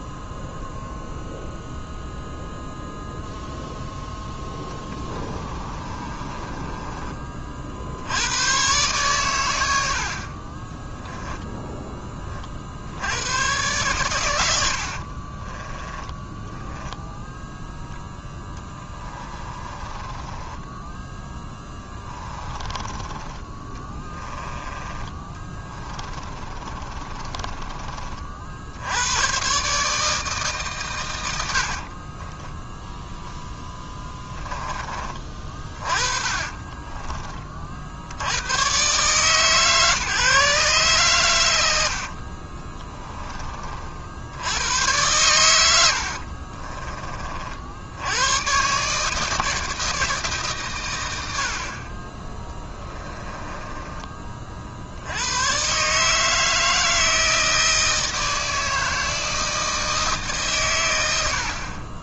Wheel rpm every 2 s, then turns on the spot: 0, 0, 20, 30, 120, 10, 70, 70, 10, 10, 10, 20, 20, 30, 80, 130, 10, 20, 30, 130, 130, 20, 110, 40, 140, 100, 20, 70, 160, 160, 110.
4-8 10-12 14-16 18-24 26-28 32-34 36-38 42-44 46-48 52-54